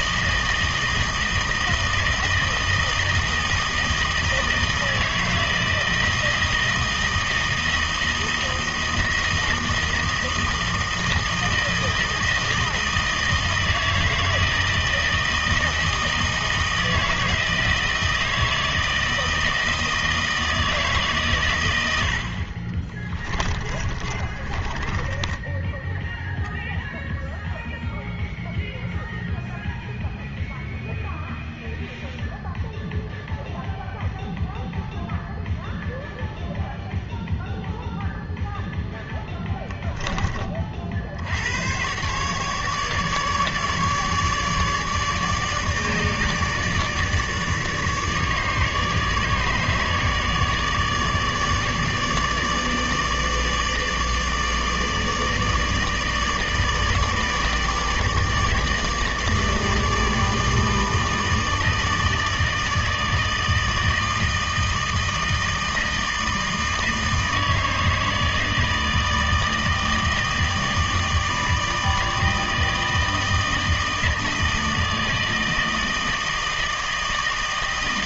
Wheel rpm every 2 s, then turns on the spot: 160, 160, 160, 160, 160, 160, 160, 160, 160, 160, 160, 30, 20, 0, 0, 0, 0, 0, 0, 0, 40, 150, 150, 150, 150, 150, 160, 150, 150, 150, 160, 160, 160, 160, 160, 160, 160, 160, 160.
22-26